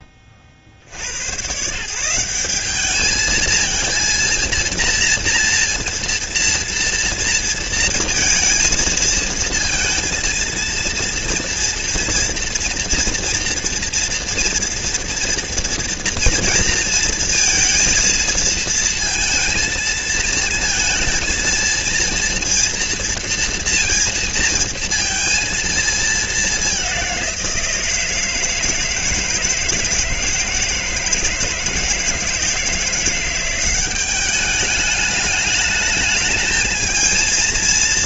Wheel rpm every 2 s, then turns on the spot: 90, 210, 230, 230, 230, 230, 230, 240, 230, 230, 230, 230, 230, 190, 160, 160, 170, 210, 220.
none